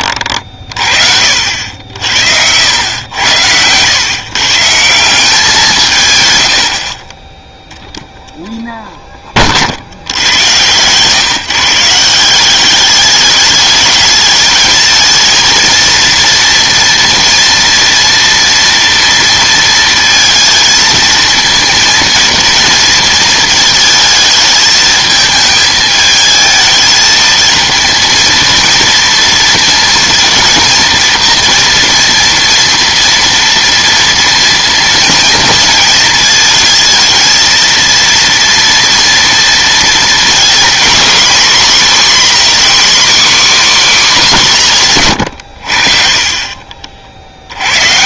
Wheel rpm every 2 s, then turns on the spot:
40, 90, 150, 70, 0, 120, 200, 220, 230, 240, 220, 230, 220, 220, 230, 230, 240, 230, 220, 230, 240, 270, 180, 40.
none